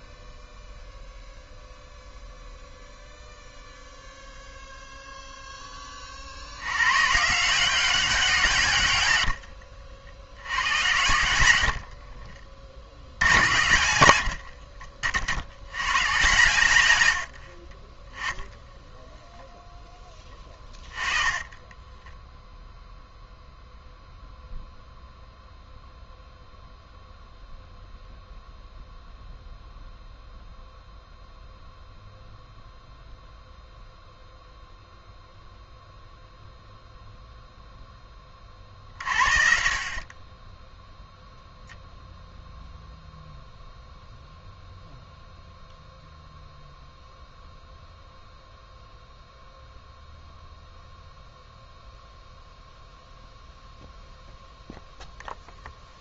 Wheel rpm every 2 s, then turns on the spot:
0, 0, 0, 130, 110, 90, 70, 60, 110, 10, 20, 0, 0, 0, 0, 0, 0, 0, 0, 50, 0, 0, 0, 0, 0, 0, 0, 0.
12-14 20-22